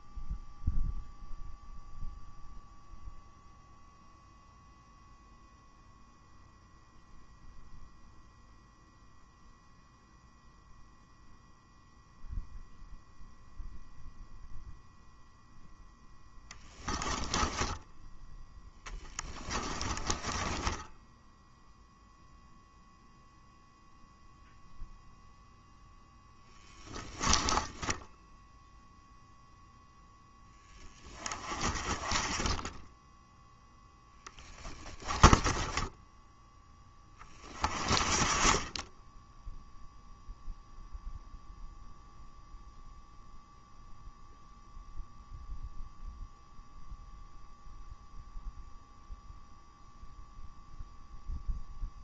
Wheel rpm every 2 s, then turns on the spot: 0, 0, 0, 0, 0, 0, 0, 0, 10, 10, 10, 0, 0, 10, 0, 20, 10, 20, 20, 10, 0, 0, 0, 0, 0, 0.
16-22 26-28